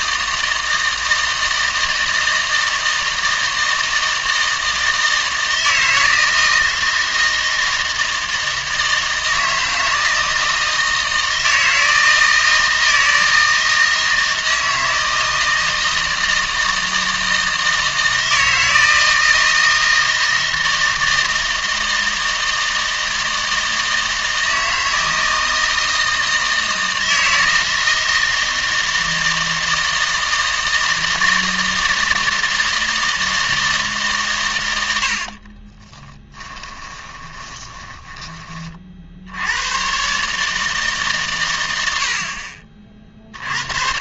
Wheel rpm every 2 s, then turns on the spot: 160, 160, 160, 160, 160, 160, 160, 160, 160, 160, 160, 160, 160, 160, 160, 160, 160, 90, 20, 30, 150, 50.
36-38